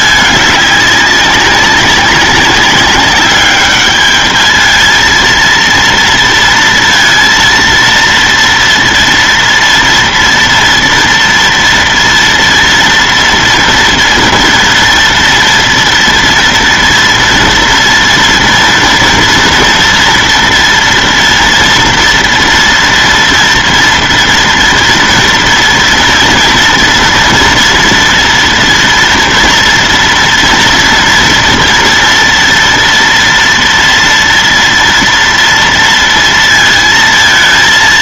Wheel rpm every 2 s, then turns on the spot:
200, 200, 220, 230, 230, 230, 230, 230, 230, 240, 230, 240, 230, 230, 230, 230, 230, 230, 230.
none